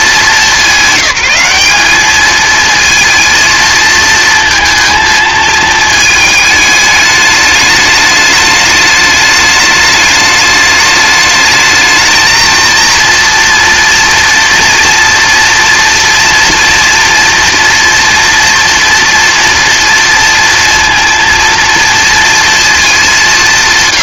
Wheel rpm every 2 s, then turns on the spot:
190, 230, 220, 210, 210, 210, 230, 230, 230, 230, 230, 220.
none